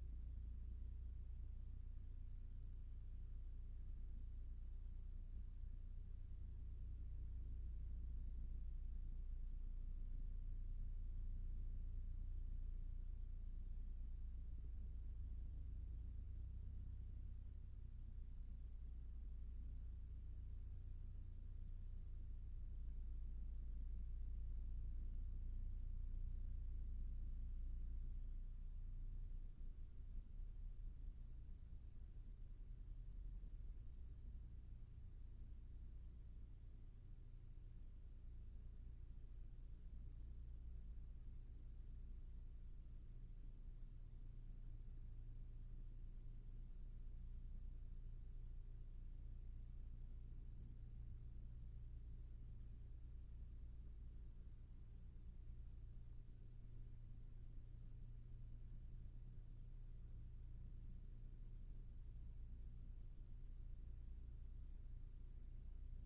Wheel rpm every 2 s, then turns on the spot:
0, 0, 0, 0, 0, 0, 0, 0, 0, 0, 0, 0, 0, 0, 0, 0, 0, 0, 0, 0, 0, 0, 0, 0, 0, 0, 0, 0, 0, 0, 0, 0, 0.
none